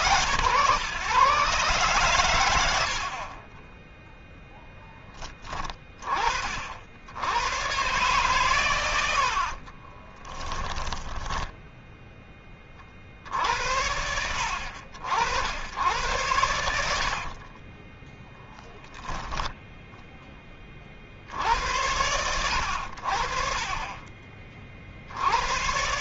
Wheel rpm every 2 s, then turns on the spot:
130, 50, 10, 70, 90, 10, 40, 70, 80, 10, 50, 60, 50.
10-12 16-18